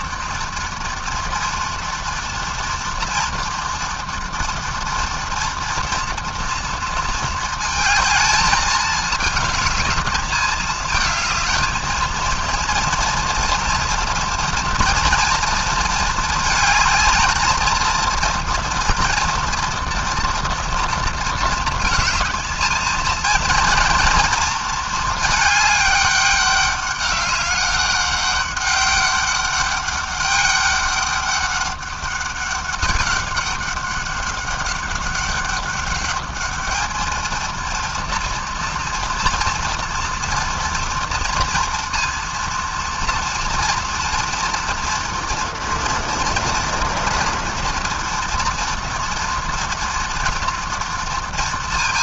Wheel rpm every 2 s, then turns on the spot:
230, 230, 240, 230, 210, 220, 230, 230, 220, 230, 230, 230, 210, 200, 200, 200, 200, 200, 220, 230, 230, 230, 230, 230, 230, 230.
none